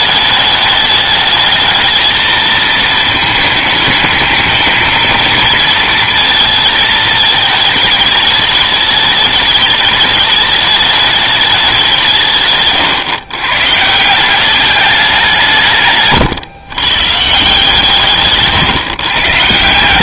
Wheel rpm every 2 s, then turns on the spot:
210, 220, 220, 220, 210, 210, 140, 200, 120, 130.
none